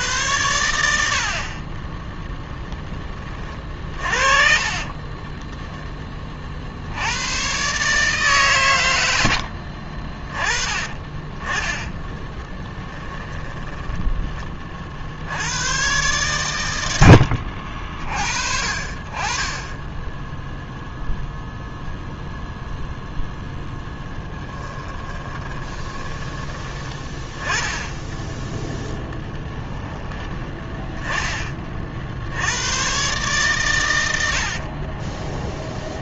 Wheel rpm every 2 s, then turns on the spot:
80, 10, 30, 70, 120, 30, 10, 50, 90, 50, 0, 0, 10, 20, 10, 10, 110, 40.
4-6 10-12 24-26 28-30 34-36